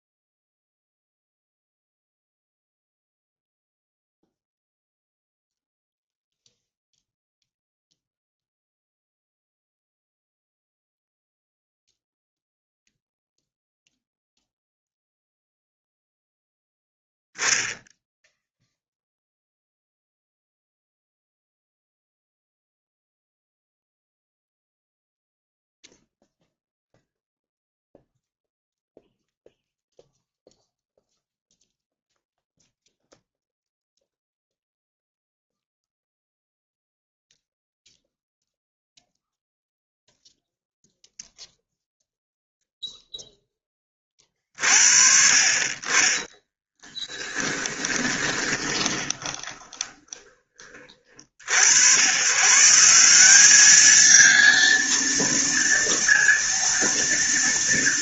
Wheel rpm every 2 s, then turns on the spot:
0, 0, 0, 0, 0, 0, 0, 0, 0, 0, 0, 0, 0, 0, 0, 0, 0, 0, 0, 0, 0, 0, 50, 10, 20, 30, 160, 230, 230.
46-50